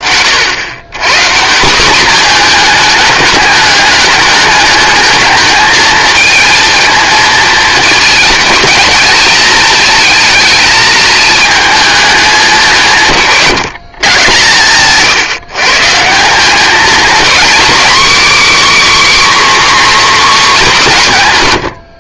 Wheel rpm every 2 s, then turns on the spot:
110, 220, 210, 220, 220, 220, 180, 140, 220, 290, 230.
none